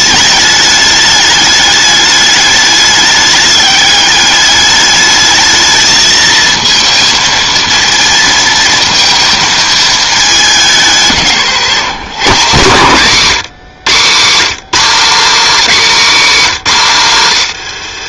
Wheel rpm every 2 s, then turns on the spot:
210, 210, 210, 230, 220, 170, 150, 230, 170.
none